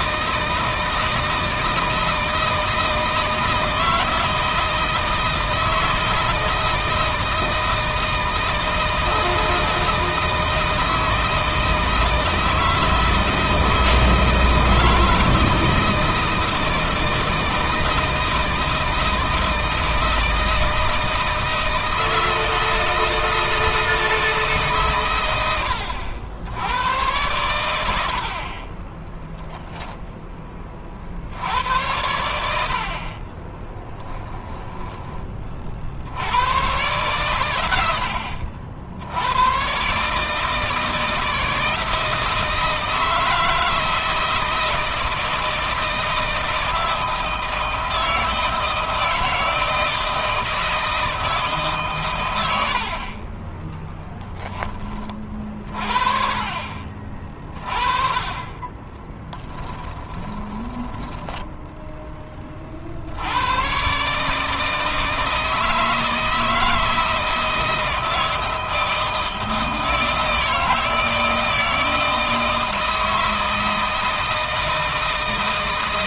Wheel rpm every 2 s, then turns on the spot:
160, 160, 160, 160, 160, 160, 160, 160, 160, 160, 160, 160, 130, 100, 20, 40, 50, 10, 110, 70, 160, 160, 160, 160, 160, 160, 60, 30, 30, 20, 10, 60, 160, 160, 160, 160, 160, 160.
28-30 58-62